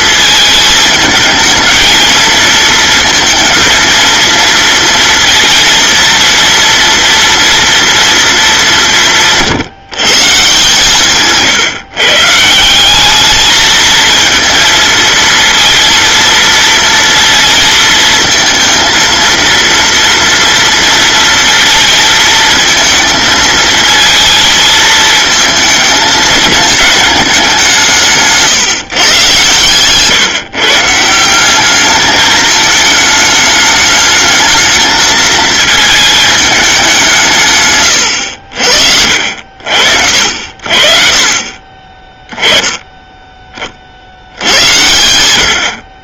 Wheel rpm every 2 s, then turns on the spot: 220, 230, 230, 230, 180, 150, 180, 220, 230, 230, 230, 230, 230, 210, 150, 150, 210, 220, 210, 60, 50, 10, 100.
none